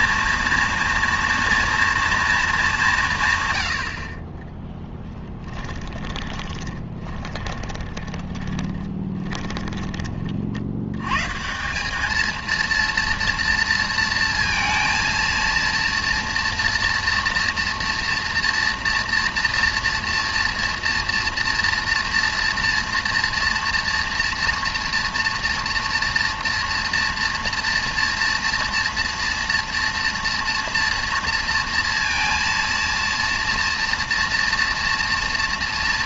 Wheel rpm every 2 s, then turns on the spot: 230, 180, 10, 20, 20, 90, 230, 230, 230, 230, 230, 230, 230, 230, 230, 230, 230, 230.
4-10